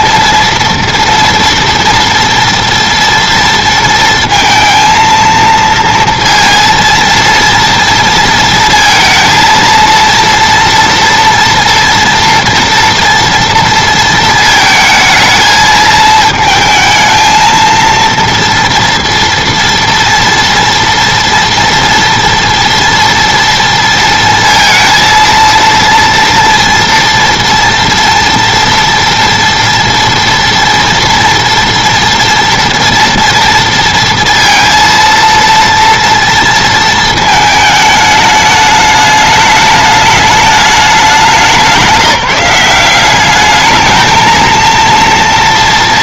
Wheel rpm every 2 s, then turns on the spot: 230, 230, 230, 230, 230, 230, 230, 220, 220, 230, 230, 230, 230, 230, 230, 230, 230, 230, 230, 210, 210, 180, 230.
none